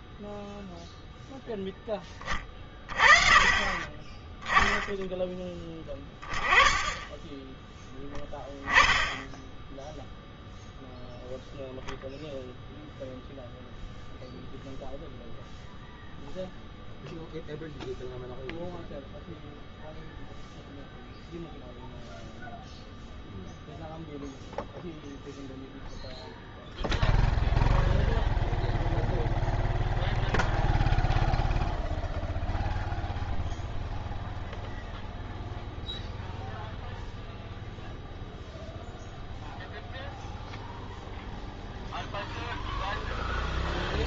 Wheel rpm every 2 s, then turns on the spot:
0, 30, 0, 10, 0, 0, 0, 0, 0, 0, 0, 0, 0, 0, 0, 0, 0, 0, 0, 0, 0, 0.
none